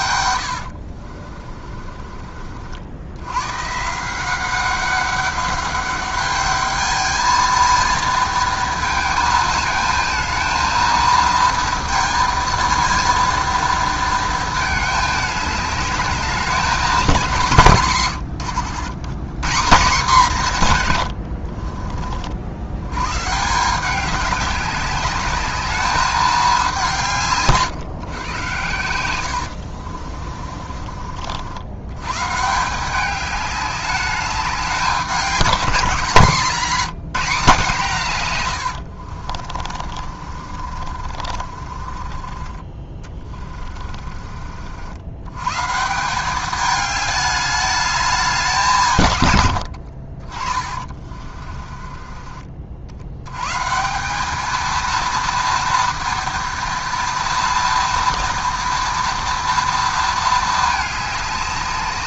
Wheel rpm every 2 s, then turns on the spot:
60, 80, 200, 220, 220, 230, 230, 210, 190, 130, 110, 100, 200, 170, 100, 40, 180, 190, 180, 80, 50, 30, 80, 210, 150, 30, 60, 230, 230, 230, 210.
0-2 28-30 38-44 50-52